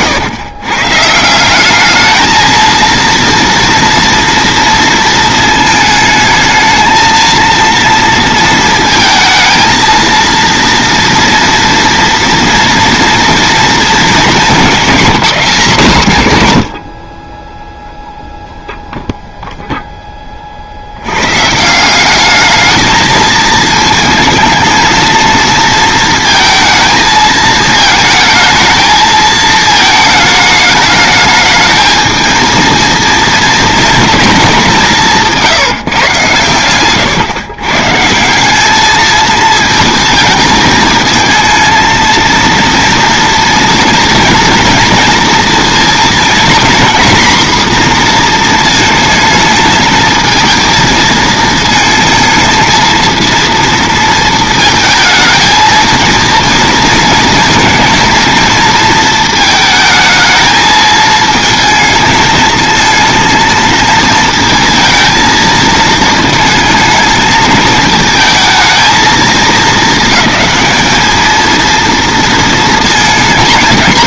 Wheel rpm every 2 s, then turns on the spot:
140, 230, 230, 220, 230, 230, 230, 230, 100, 0, 60, 220, 220, 220, 220, 210, 230, 180, 130, 210, 220, 230, 230, 240, 230, 230, 220, 220, 230, 230, 220, 230, 230, 220, 220, 210, 220.
36-38